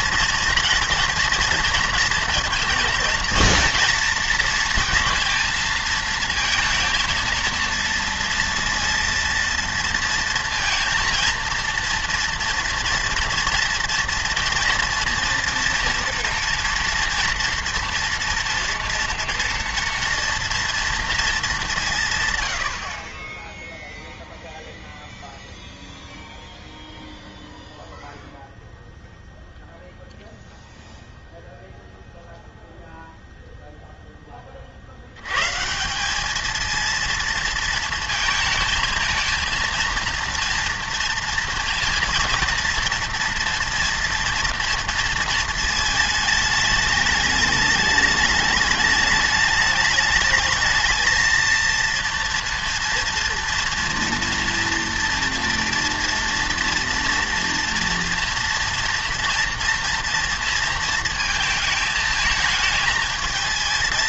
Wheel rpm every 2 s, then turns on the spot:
230, 230, 230, 230, 230, 230, 230, 230, 240, 240, 230, 110, 0, 0, 0, 0, 0, 30, 220, 230, 230, 230, 230, 210, 210, 220, 230, 230, 230, 230, 230, 220.
none